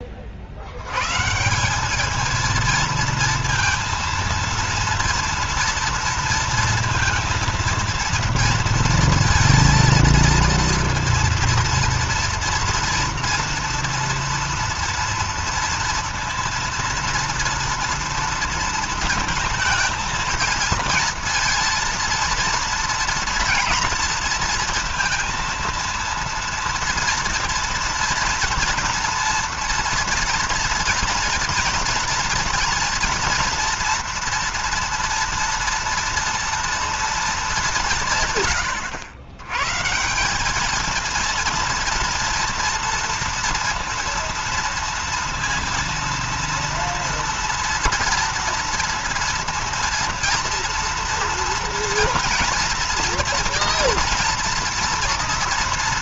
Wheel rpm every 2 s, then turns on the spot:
60, 220, 230, 230, 230, 230, 230, 230, 230, 230, 230, 230, 230, 230, 230, 230, 230, 230, 230, 130, 200, 230, 230, 230, 230, 230, 230, 230.
none